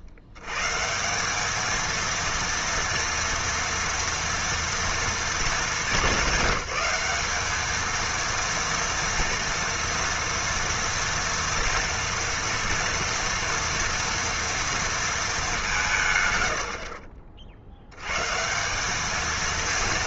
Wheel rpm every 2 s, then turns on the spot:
120, 230, 240, 200, 230, 230, 230, 230, 120, 180.
none